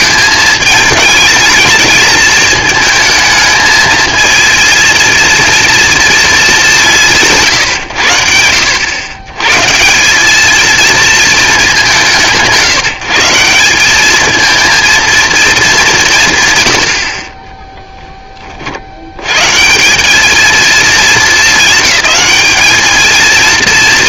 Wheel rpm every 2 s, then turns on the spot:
210, 220, 230, 200, 80, 220, 170, 230, 120, 30, 220, 220.
none